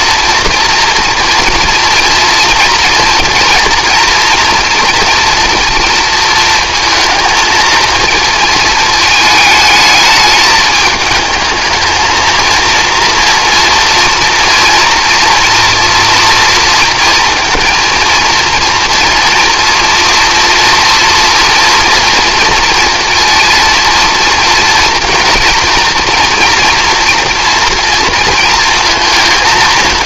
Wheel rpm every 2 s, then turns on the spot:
230, 240, 240, 230, 220, 220, 230, 230, 230, 230, 230, 230, 230, 240, 230.
none